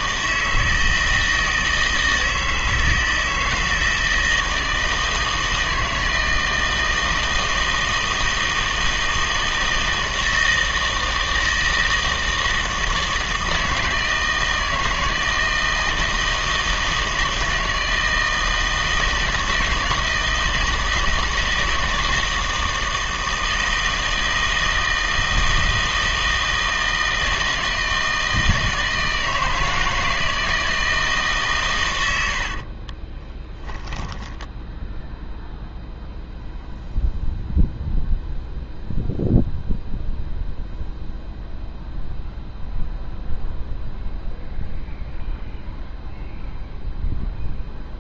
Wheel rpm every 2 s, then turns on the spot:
160, 160, 160, 160, 160, 160, 160, 160, 160, 160, 160, 160, 160, 160, 160, 160, 60, 10, 0, 0, 0, 0, 0, 0.
32-36